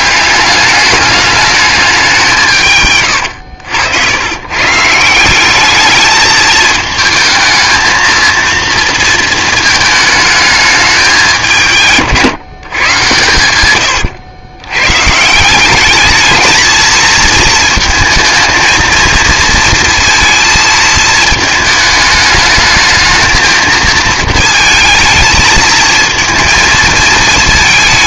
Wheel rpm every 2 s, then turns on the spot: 200, 140, 140, 220, 230, 210, 140, 130, 220, 230, 230, 220, 220, 220.
none